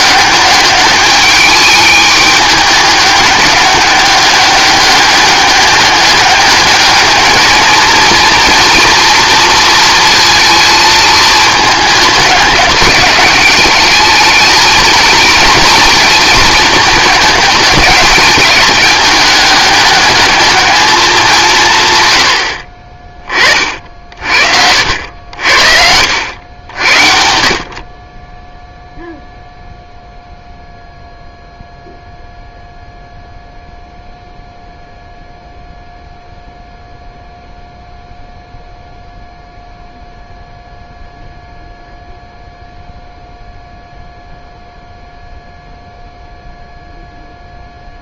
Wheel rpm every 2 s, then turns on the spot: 200, 210, 200, 210, 240, 230, 200, 220, 220, 210, 210, 60, 60, 80, 0, 0, 0, 0, 0, 0, 0, 0, 0, 0.
none